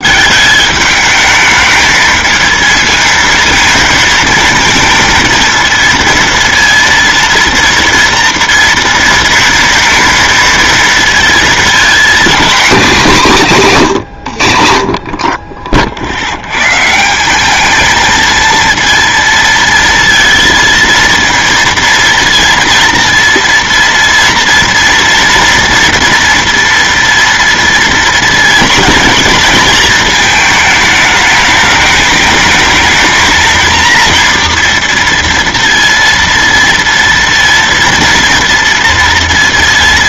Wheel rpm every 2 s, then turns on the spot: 210, 220, 230, 230, 230, 230, 220, 50, 130, 230, 230, 230, 230, 230, 230, 220, 220, 230, 230, 230.
12-14